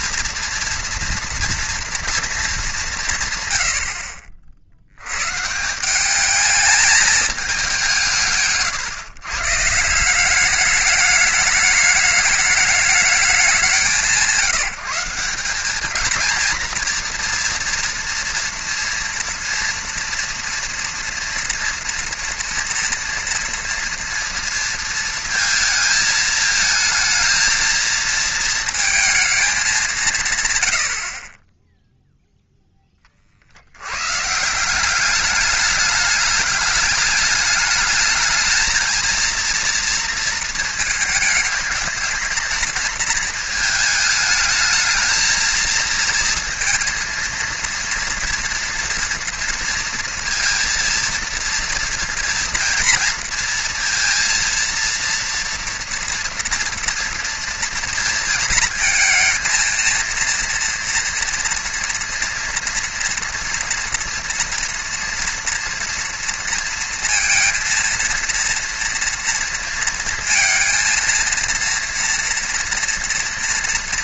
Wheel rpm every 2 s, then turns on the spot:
230, 210, 60, 210, 150, 200, 210, 170, 220, 230, 230, 230, 230, 220, 230, 130, 0, 160, 210, 220, 230, 220, 220, 230, 230, 230, 230, 230, 240, 230, 230, 240, 230, 230, 230, 230, 230.
8-10